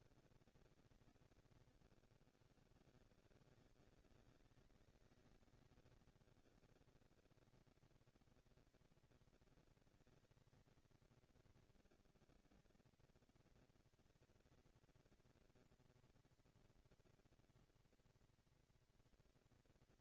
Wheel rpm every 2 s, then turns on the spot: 230, 140, 200, 210, 230, 220, 200, 220, 230, 230.
none